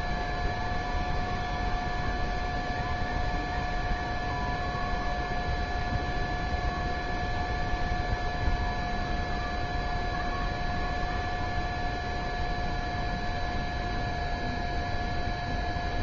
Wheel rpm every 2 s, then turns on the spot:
0, 0, 0, 0, 0, 0, 0, 0.
none